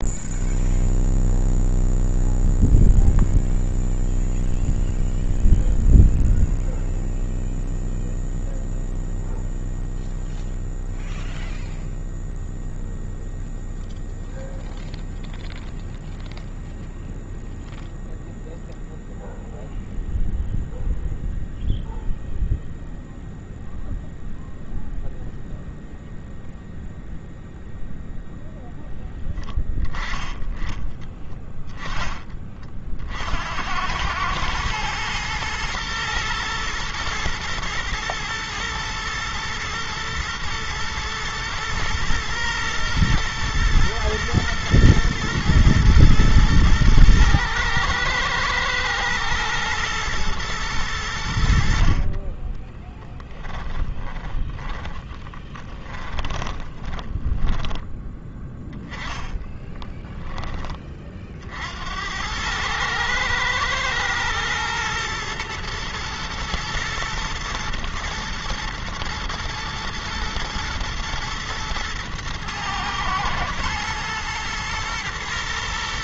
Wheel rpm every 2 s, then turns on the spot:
0, 0, 0, 0, 0, 0, 0, 0, 0, 0, 0, 0, 0, 0, 0, 10, 50, 110, 120, 120, 110, 120, 110, 110, 110, 100, 20, 20, 20, 10, 30, 110, 110, 110, 120, 120, 110, 110.
52-60